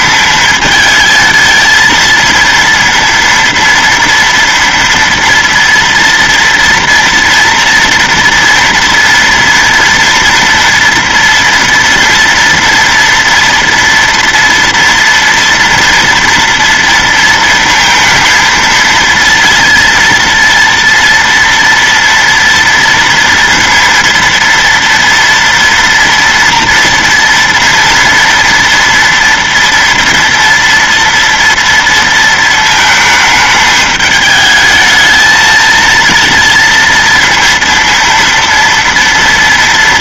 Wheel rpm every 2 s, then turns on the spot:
220, 230, 230, 230, 230, 230, 230, 230, 230, 230, 230, 230, 230, 230, 230, 230, 230, 210, 230, 230.
none